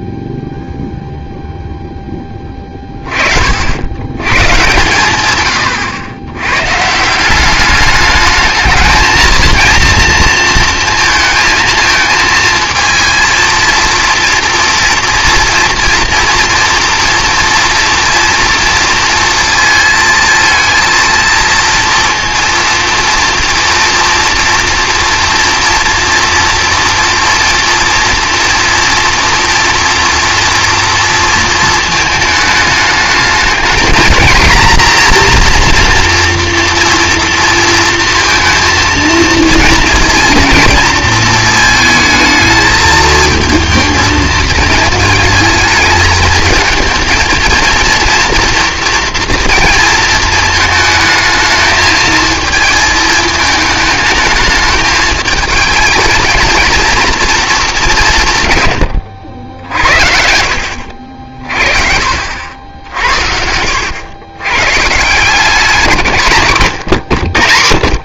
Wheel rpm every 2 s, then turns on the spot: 0, 30, 120, 160, 220, 230, 230, 230, 230, 230, 230, 230, 230, 230, 240, 230, 210, 240, 240, 230, 220, 220, 220, 230, 240, 220, 220, 220, 230, 90, 60, 70, 170, 80.
60-64